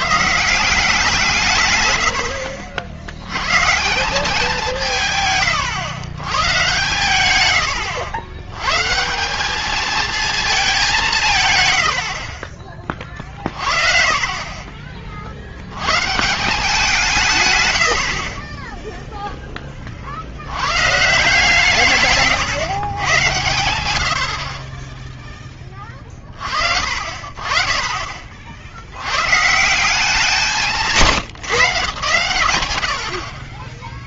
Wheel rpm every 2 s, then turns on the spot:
170, 60, 170, 120, 140, 200, 30, 30, 170, 10, 110, 120, 30, 50, 80, 160, 90.
14-16 18-20